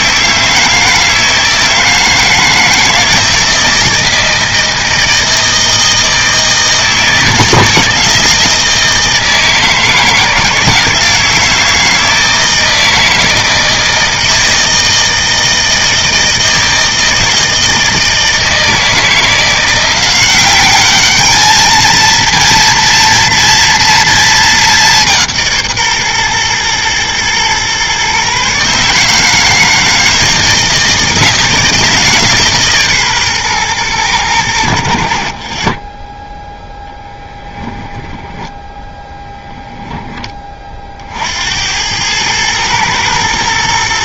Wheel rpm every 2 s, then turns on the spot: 160, 160, 160, 160, 160, 160, 160, 160, 160, 160, 200, 230, 200, 120, 140, 160, 150, 80, 0, 0, 40, 110.
none